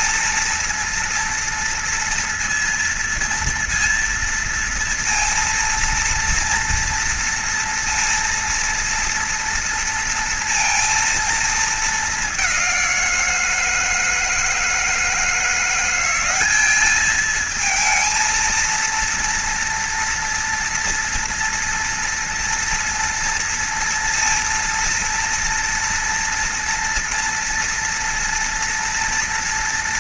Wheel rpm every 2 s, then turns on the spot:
230, 230, 230, 230, 240, 230, 180, 160, 210, 230, 230, 230, 230, 230, 230.
none